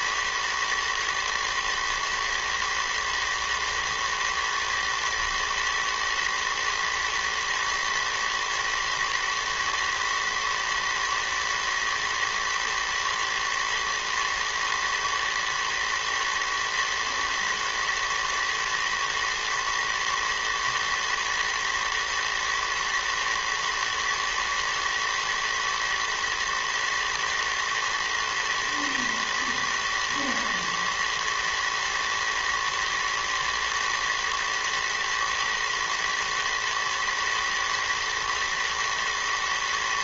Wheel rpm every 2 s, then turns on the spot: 110, 110, 110, 110, 110, 110, 110, 110, 110, 110, 120, 120, 110, 110, 110, 120, 110, 110, 110, 110.
none